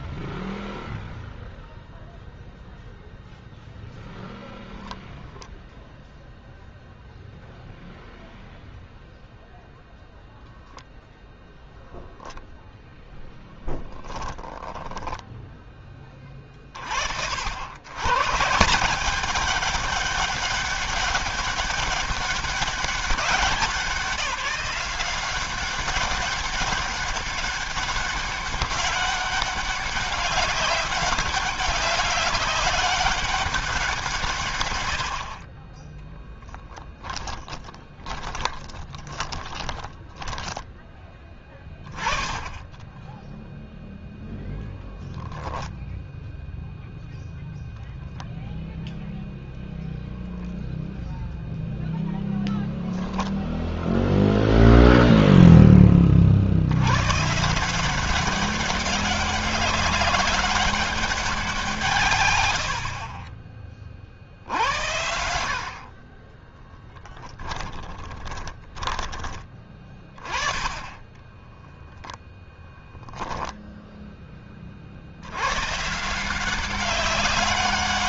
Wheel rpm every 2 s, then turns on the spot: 0, 0, 0, 0, 0, 0, 10, 10, 80, 200, 200, 190, 190, 200, 200, 200, 190, 30, 20, 20, 10, 0, 20, 0, 0, 0, 0, 0, 110, 200, 190, 50, 80, 10, 20, 20, 10, 30, 190.
12-14 36-40 44-46 66-72